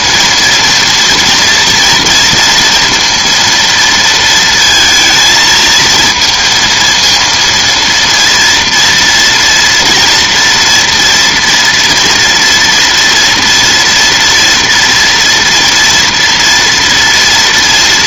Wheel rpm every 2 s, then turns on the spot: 230, 230, 230, 230, 230, 230, 240, 230, 230.
none